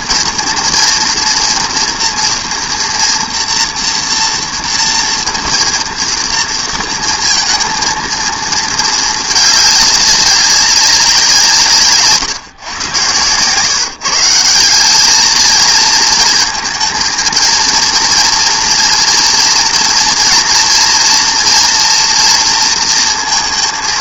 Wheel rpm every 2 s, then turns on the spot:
230, 240, 240, 230, 220, 200, 130, 180, 220, 230, 230, 230.
none